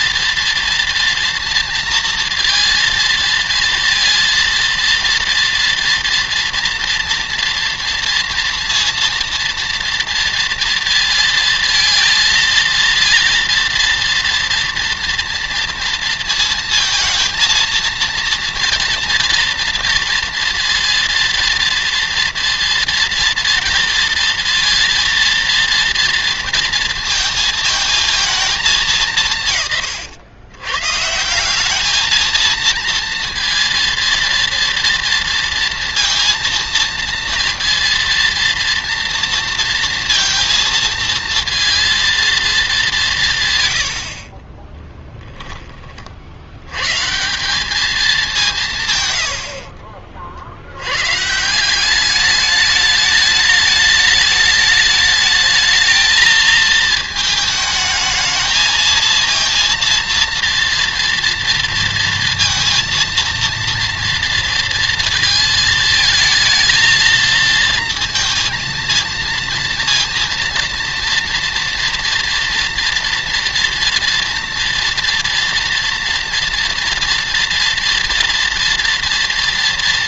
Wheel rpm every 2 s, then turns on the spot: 230, 230, 230, 230, 230, 230, 230, 230, 230, 230, 230, 230, 230, 230, 190, 130, 230, 230, 230, 230, 230, 210, 30, 110, 150, 90, 210, 210, 220, 220, 230, 230, 230, 220, 230, 230, 230, 230, 230, 230.
44-46